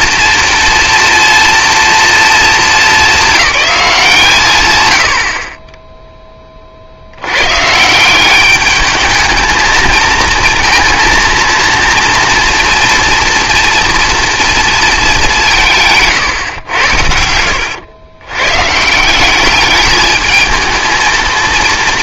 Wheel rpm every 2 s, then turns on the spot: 230, 230, 150, 20, 190, 220, 230, 230, 130, 110, 210.
16-18